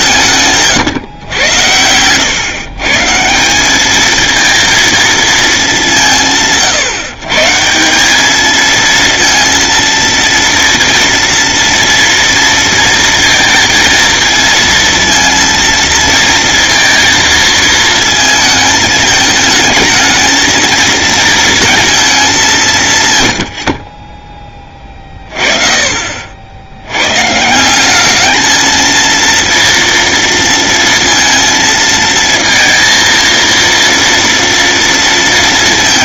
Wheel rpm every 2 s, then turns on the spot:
110, 170, 220, 140, 230, 240, 230, 230, 230, 220, 230, 120, 40, 120, 230, 230, 230, 230.
24-26